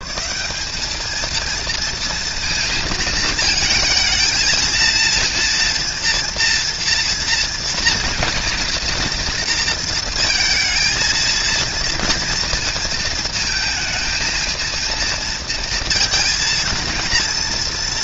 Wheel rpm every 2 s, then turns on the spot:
210, 230, 230, 230, 230, 230, 230, 230, 230.
none